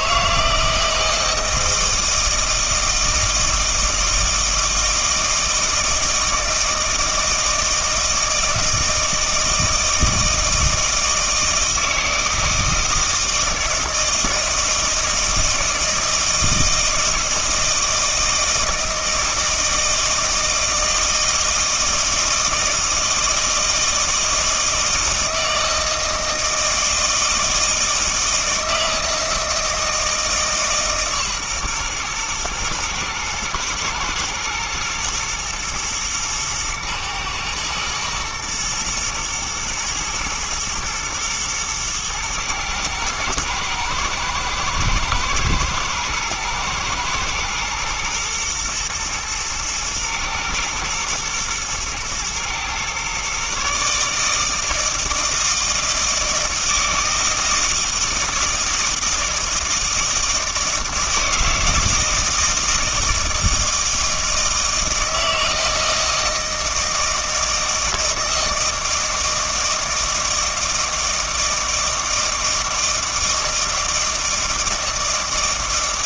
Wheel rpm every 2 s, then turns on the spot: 160, 160, 160, 160, 160, 160, 160, 160, 160, 160, 160, 160, 160, 160, 160, 150, 120, 120, 120, 120, 120, 110, 110, 110, 120, 120, 120, 160, 160, 160, 160, 160, 160, 160, 160, 160, 160, 160.
none